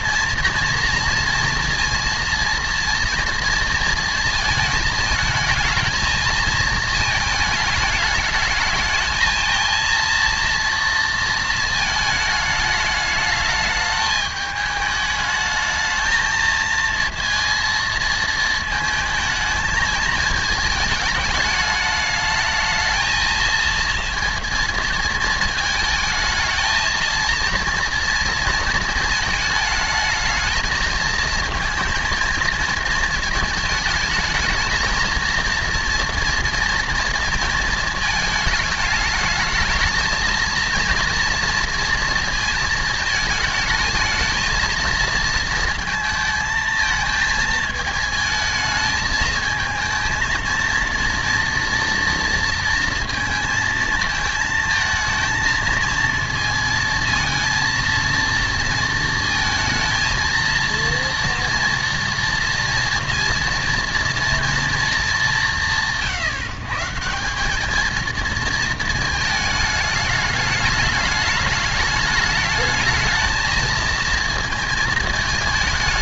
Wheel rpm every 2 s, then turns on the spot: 240, 230, 220, 220, 220, 230, 210, 210, 230, 220, 220, 220, 230, 220, 220, 220, 230, 220, 230, 210, 230, 220, 230, 230, 220, 230, 230, 220, 230, 230, 230, 230, 230, 150, 220, 210, 210, 220.
none